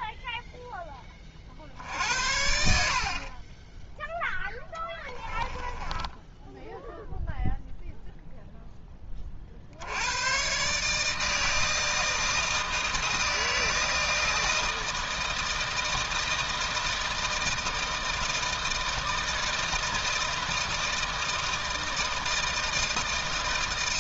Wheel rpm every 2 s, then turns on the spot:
10, 60, 10, 0, 10, 140, 160, 160, 160, 160, 160, 160.
2-6